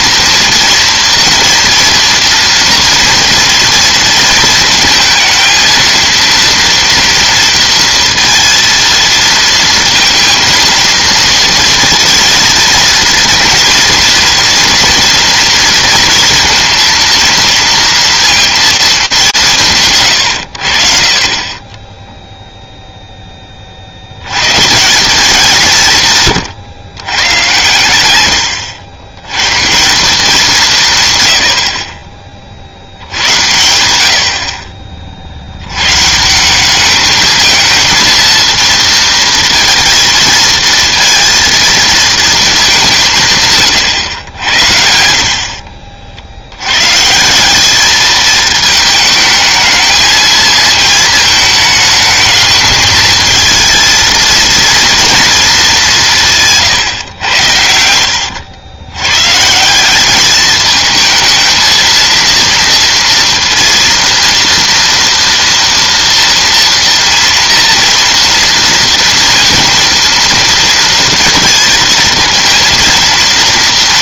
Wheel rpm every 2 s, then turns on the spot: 230, 230, 230, 230, 230, 220, 230, 240, 230, 230, 100, 0, 110, 130, 90, 170, 70, 40, 190, 230, 230, 190, 70, 120, 220, 220, 220, 230, 140, 110, 220, 230, 230, 240, 230, 230, 230.
none